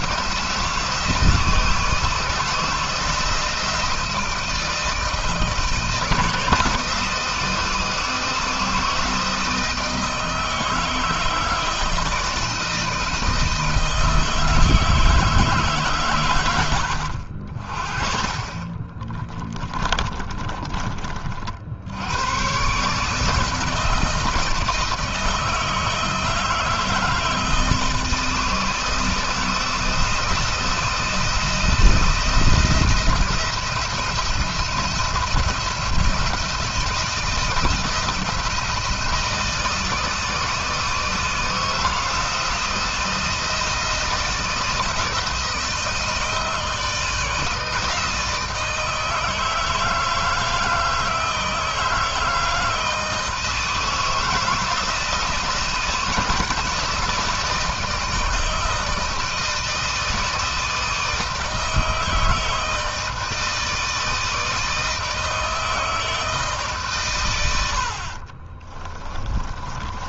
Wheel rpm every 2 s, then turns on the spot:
160, 160, 160, 160, 160, 160, 160, 160, 80, 30, 30, 140, 160, 160, 160, 170, 170, 170, 170, 170, 160, 170, 160, 160, 160, 160, 160, 160, 160, 160, 160, 160, 160, 140, 30.
18-20 68-70